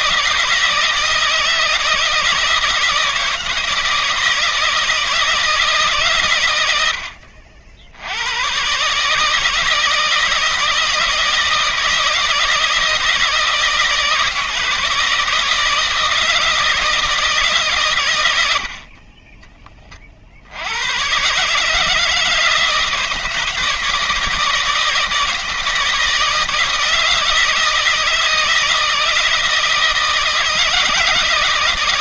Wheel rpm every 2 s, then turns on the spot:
160, 160, 160, 80, 140, 160, 160, 160, 160, 50, 110, 160, 170, 160, 160, 160.
none